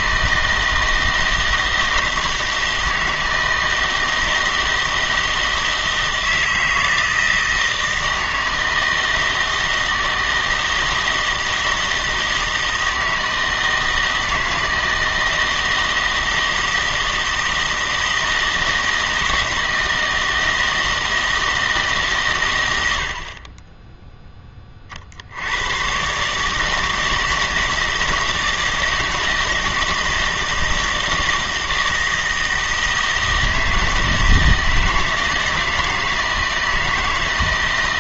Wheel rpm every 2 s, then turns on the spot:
160, 160, 160, 160, 160, 160, 160, 160, 160, 160, 160, 110, 30, 160, 160, 160, 160, 160, 160.
none